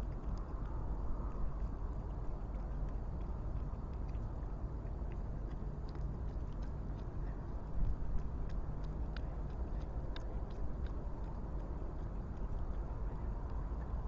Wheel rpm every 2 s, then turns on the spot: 0, 0, 0, 0, 0, 0, 0.
none